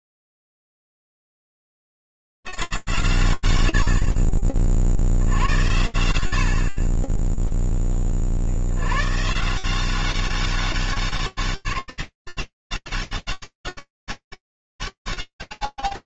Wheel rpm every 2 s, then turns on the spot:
40, 140, 40, 70, 70, 190, 190, 200.
none